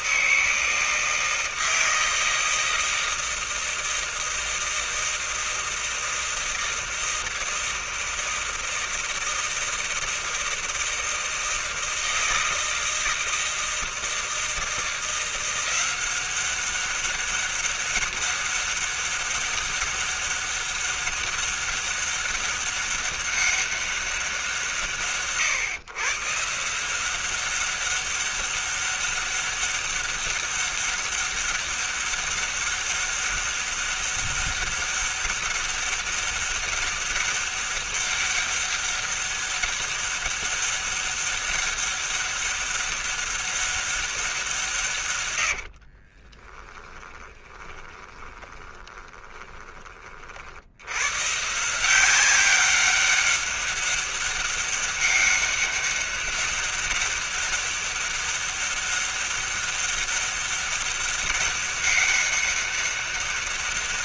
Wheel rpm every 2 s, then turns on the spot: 160, 160, 160, 160, 160, 160, 160, 160, 180, 200, 200, 200, 190, 130, 200, 200, 200, 200, 200, 200, 200, 200, 190, 40, 20, 30, 190, 200, 200, 200, 200, 200.
46-50